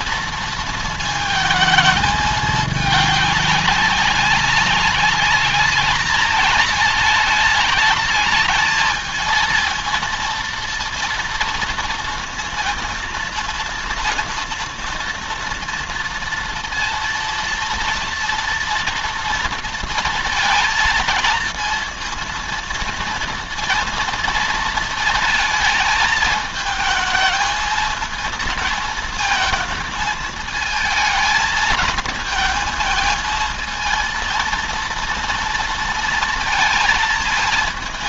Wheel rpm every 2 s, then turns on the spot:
230, 210, 200, 210, 220, 230, 230, 230, 230, 230, 230, 230, 220, 220, 230, 220, 220, 230, 230.
none